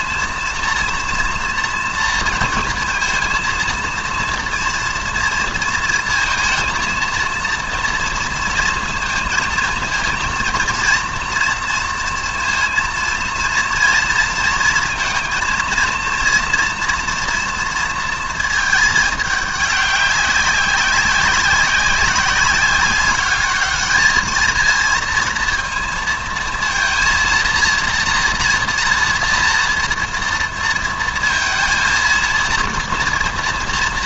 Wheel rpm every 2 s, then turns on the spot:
240, 230, 230, 230, 230, 230, 230, 220, 230, 220, 190, 200, 220, 230, 240, 230, 230.
none